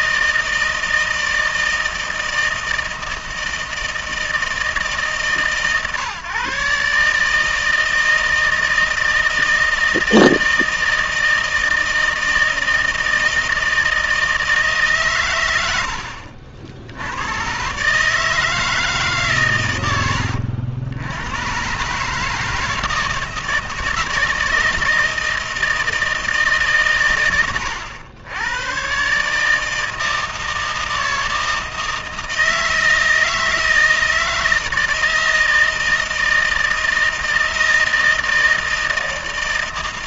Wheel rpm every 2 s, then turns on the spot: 160, 160, 160, 140, 160, 160, 160, 160, 60, 160, 80, 160, 160, 150, 100, 160, 160, 160, 160, 160.
none